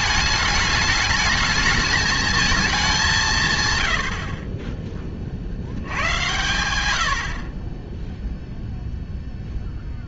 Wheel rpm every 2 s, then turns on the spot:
210, 200, 20, 90, 0.
none